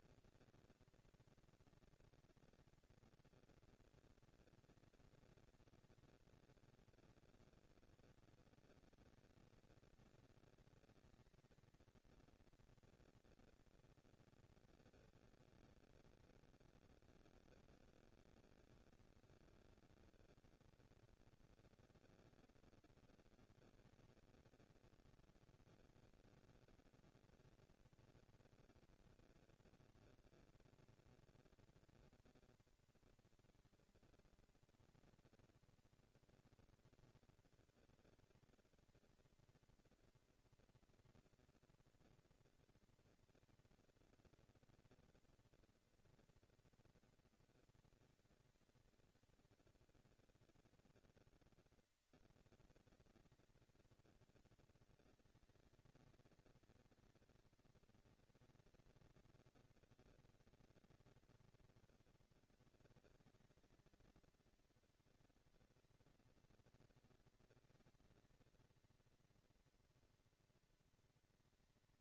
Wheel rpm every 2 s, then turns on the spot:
230, 230, 230, 230, 230, 230, 230, 230, 220, 200, 210, 230, 230, 230, 230, 230, 230, 230, 230, 230, 230, 230, 230, 230, 220, 200, 200, 210, 230, 230, 230, 230, 230, 230, 230, 230.
none